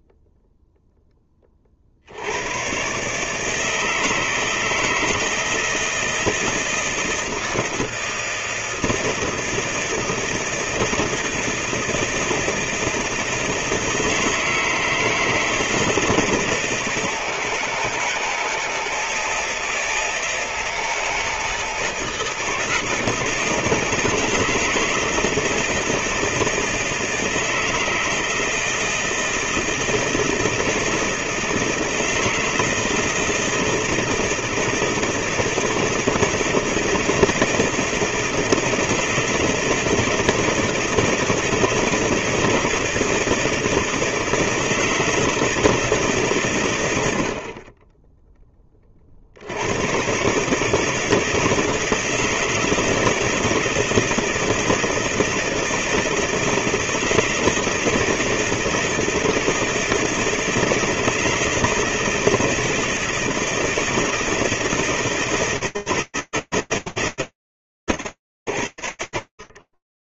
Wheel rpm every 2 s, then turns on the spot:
0, 110, 160, 160, 160, 170, 160, 160, 160, 160, 160, 160, 160, 160, 160, 160, 160, 160, 160, 160, 160, 160, 160, 120, 20, 140, 160, 170, 170, 160, 160, 160, 160, 160, 110.
none